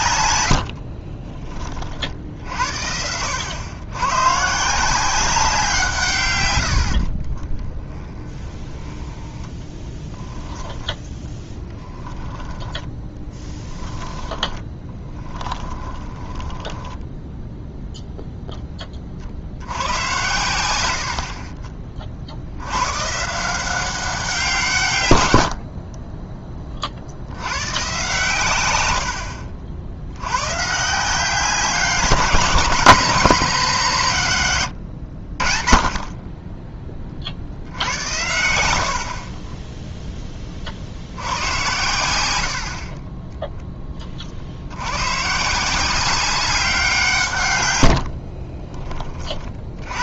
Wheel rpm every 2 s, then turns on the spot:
80, 60, 150, 90, 10, 10, 10, 20, 10, 10, 100, 100, 160, 30, 100, 140, 190, 110, 20, 70, 50, 50, 80, 180, 30.
0-2 6-18 38-40 48-50